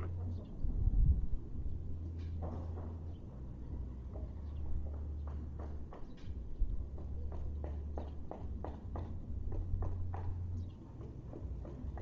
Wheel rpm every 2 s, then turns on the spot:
0, 0, 0, 0, 0, 0.
none